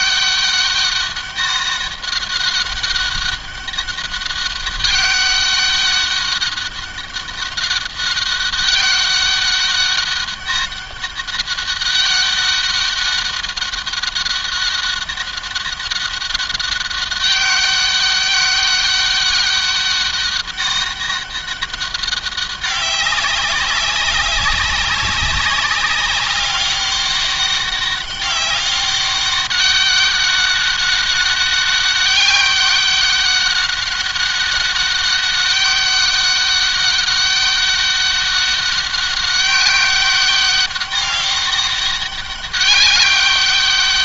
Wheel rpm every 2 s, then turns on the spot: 200, 200, 200, 200, 200, 200, 200, 200, 200, 200, 200, 190, 190, 200, 200, 200, 200, 200, 200, 200, 200, 200.
none